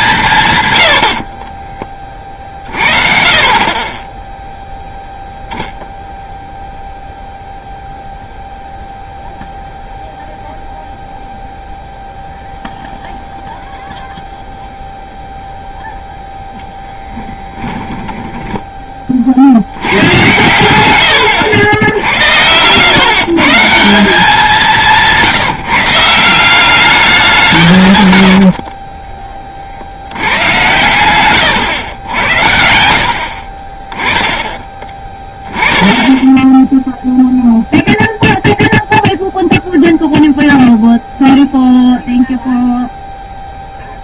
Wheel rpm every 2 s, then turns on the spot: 150, 50, 0, 0, 0, 0, 0, 0, 0, 10, 100, 90, 190, 190, 50, 110, 90, 20, 10, 0, 0, 0.
18-20 28-32